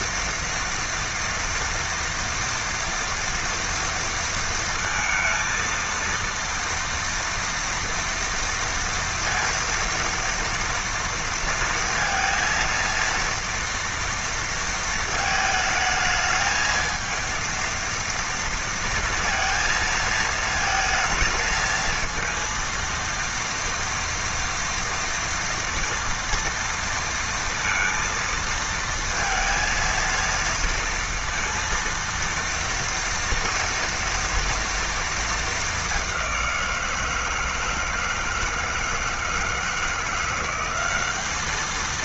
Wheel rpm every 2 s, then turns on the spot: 230, 230, 230, 230, 230, 230, 230, 230, 220, 230, 220, 230, 230, 230, 230, 230, 230, 230, 180, 160, 180.
none